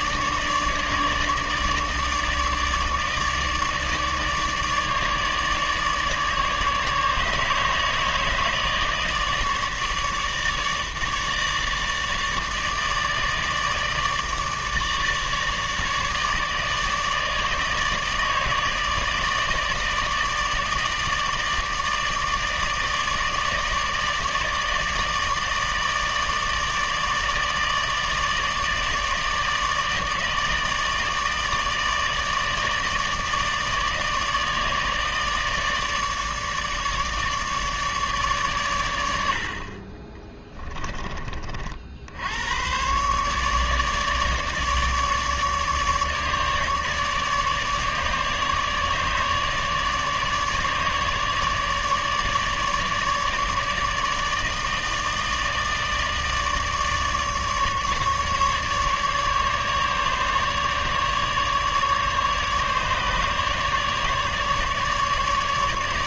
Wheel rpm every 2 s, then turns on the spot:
150, 150, 150, 150, 150, 150, 150, 150, 150, 150, 160, 150, 160, 150, 160, 150, 150, 160, 150, 140, 20, 80, 150, 150, 150, 150, 150, 160, 150, 150, 150, 150, 150.
40-42